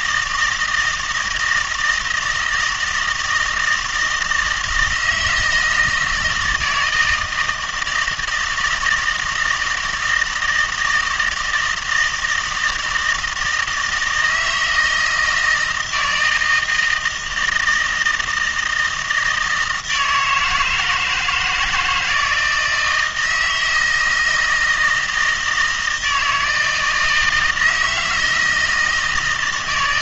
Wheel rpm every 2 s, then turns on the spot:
160, 160, 160, 160, 160, 160, 160, 160, 160, 160, 160, 160, 160, 160, 160.
none